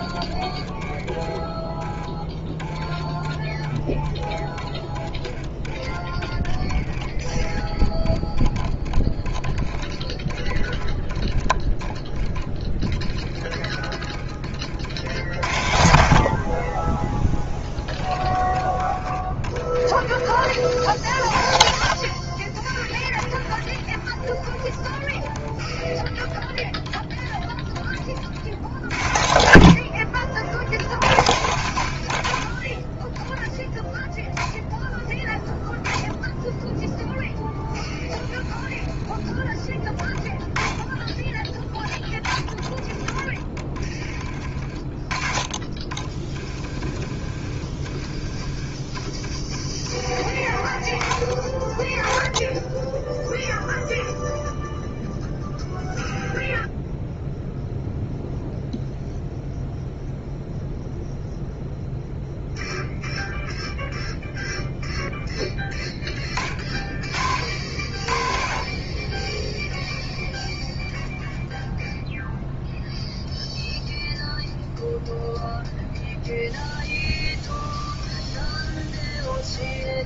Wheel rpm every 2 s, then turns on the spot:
20, 10, 10, 10, 10, 20, 20, 40, 40, 10, 30, 20, 20, 10, 60, 50, 30, 0, 10, 20, 10, 20, 30, 30, 20, 20, 10, 0, 0, 0, 0, 0, 0, 30, 30, 0, 0, 0, 0, 0.
0-4 8-14 42-44 46-50